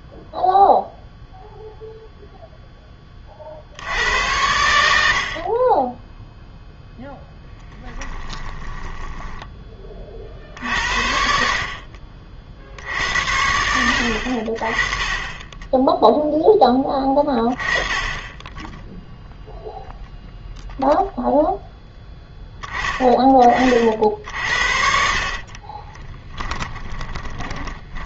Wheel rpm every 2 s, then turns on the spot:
0, 10, 80, 0, 10, 60, 60, 30, 10, 10, 0, 10, 60, 20.
8-10 24-28